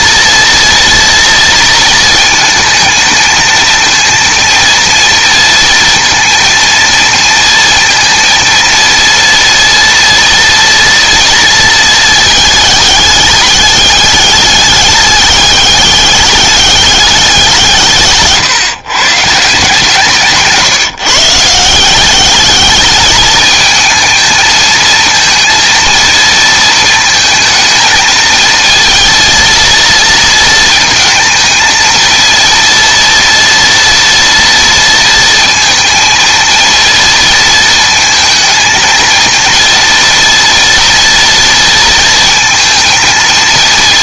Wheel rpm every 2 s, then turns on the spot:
230, 220, 230, 230, 230, 230, 210, 210, 200, 130, 160, 210, 230, 230, 230, 220, 230, 230, 230, 230, 230, 220.
none